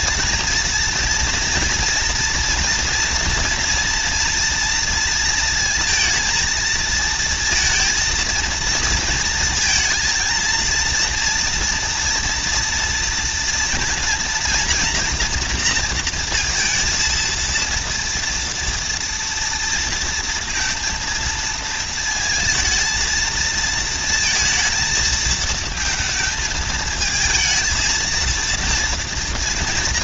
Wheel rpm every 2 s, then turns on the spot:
230, 230, 230, 220, 230, 230, 230, 240, 230, 230, 230, 230, 230, 220, 230.
none